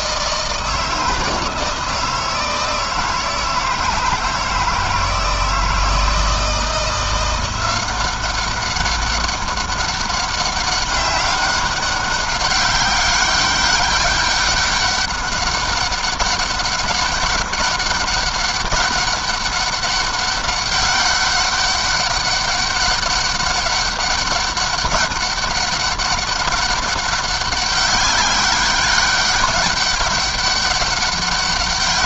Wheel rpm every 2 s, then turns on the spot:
160, 160, 160, 170, 190, 200, 200, 200, 200, 200, 200, 200, 200, 190, 200, 200.
none